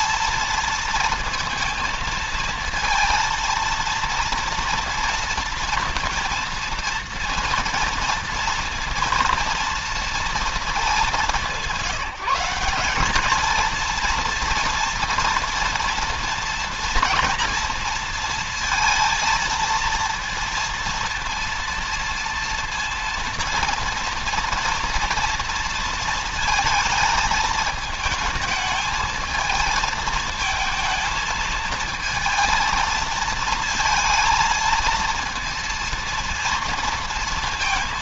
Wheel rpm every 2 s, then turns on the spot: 230, 230, 230, 230, 230, 210, 200, 230, 240, 230, 230, 230, 230, 220, 220, 220, 230, 230, 230.
none